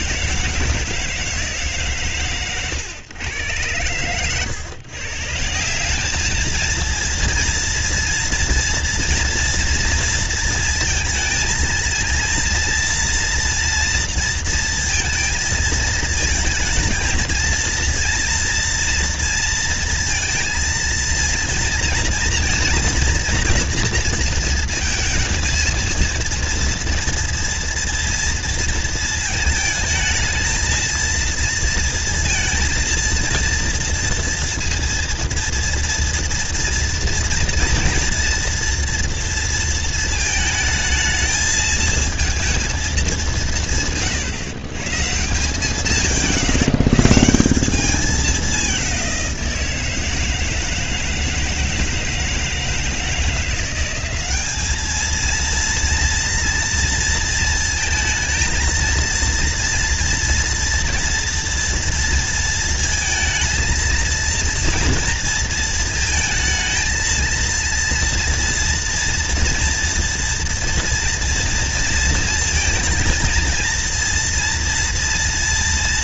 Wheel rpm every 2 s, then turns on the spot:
170, 120, 120, 210, 230, 230, 230, 230, 230, 230, 230, 230, 230, 230, 230, 220, 230, 230, 230, 230, 220, 230, 160, 150, 210, 160, 160, 200, 230, 230, 230, 230, 230, 230, 230, 240, 230, 230.
4-6